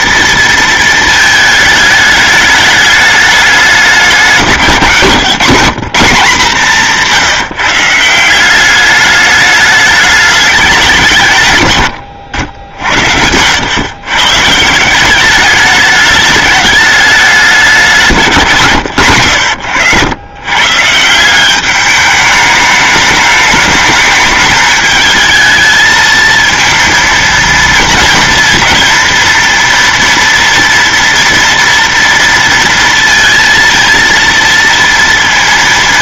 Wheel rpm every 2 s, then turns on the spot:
230, 210, 170, 170, 190, 200, 70, 140, 210, 160, 130, 210, 220, 230, 230, 230, 230, 230.
none